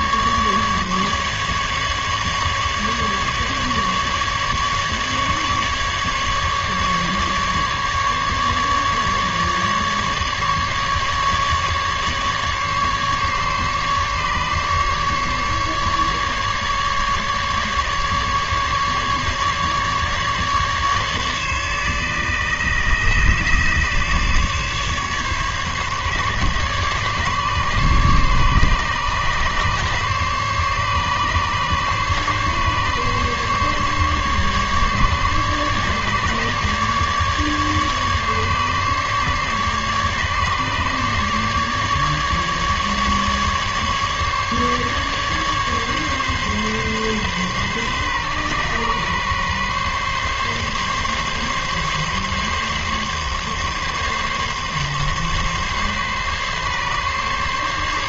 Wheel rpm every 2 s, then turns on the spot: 150, 150, 140, 150, 150, 150, 140, 150, 140, 150, 150, 140, 140, 140, 140, 140, 140, 140, 140, 140, 150, 150, 150, 140, 130, 140, 140, 140, 140.
none